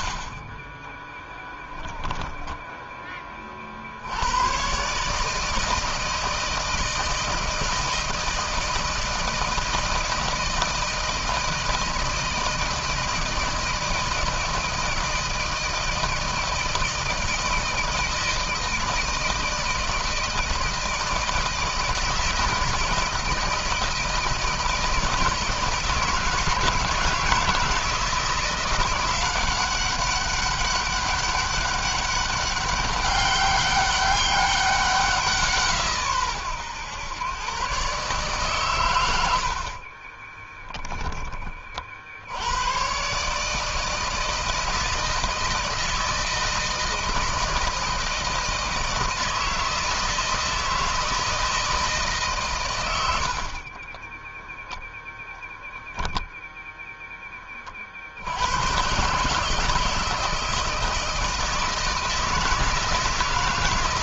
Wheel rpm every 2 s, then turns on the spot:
20, 10, 130, 160, 160, 160, 160, 160, 160, 160, 160, 160, 160, 160, 180, 200, 200, 190, 110, 110, 10, 120, 160, 160, 160, 160, 100, 0, 0, 120, 160, 160.
0-2